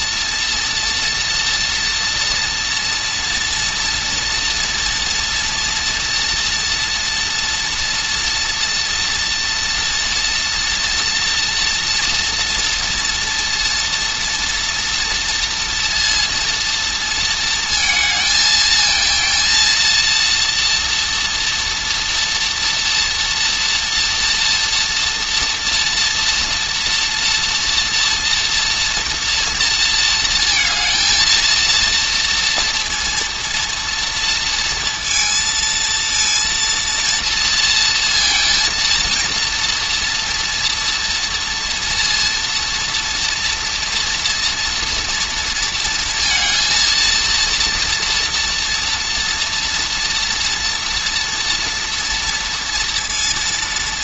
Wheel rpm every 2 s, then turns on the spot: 230, 230, 230, 230, 230, 230, 230, 230, 220, 220, 240, 230, 230, 230, 230, 220, 230, 230, 230, 230, 230, 230, 230, 230, 230, 230, 230.
none